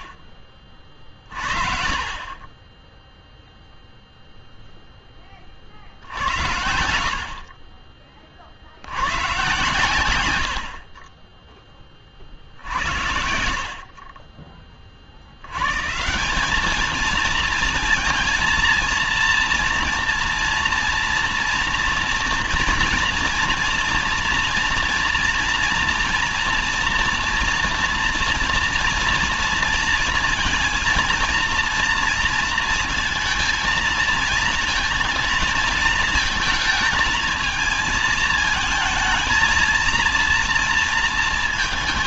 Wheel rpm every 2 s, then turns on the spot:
40, 0, 10, 70, 100, 30, 70, 80, 220, 230, 230, 230, 230, 240, 230, 230, 230, 220, 220, 220, 190.
none